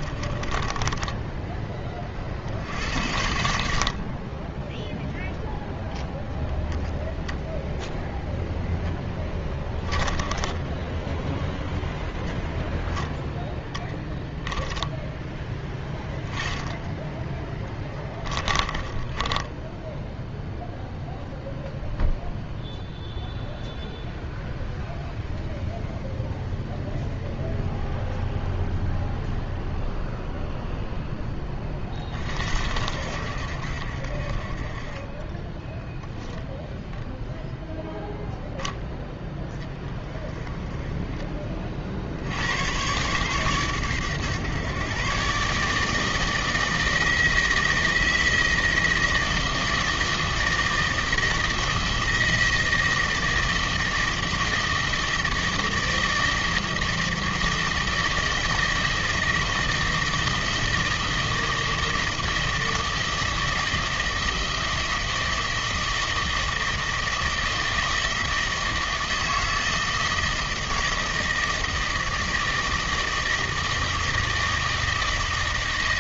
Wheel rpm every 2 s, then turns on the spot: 20, 70, 10, 0, 10, 10, 0, 10, 10, 20, 0, 0, 0, 0, 0, 0, 60, 30, 10, 0, 20, 110, 130, 160, 160, 160, 160, 160, 160, 160, 160, 160, 160, 160, 160, 160, 160, 160.
0-2 8-10 18-20 40-42